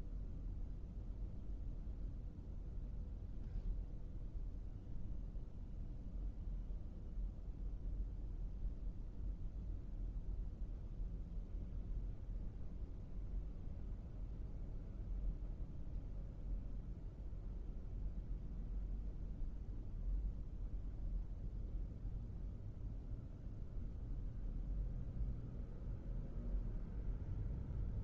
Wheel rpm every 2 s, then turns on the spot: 0, 0, 0, 0, 0, 0, 0, 0, 0, 0, 0, 0, 0, 0.
none